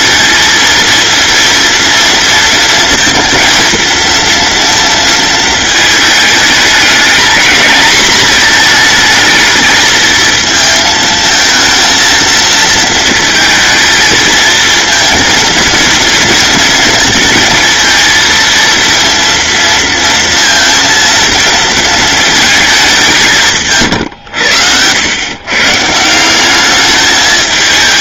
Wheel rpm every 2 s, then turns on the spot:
230, 230, 230, 220, 220, 220, 220, 230, 230, 230, 230, 210, 100, 200.
none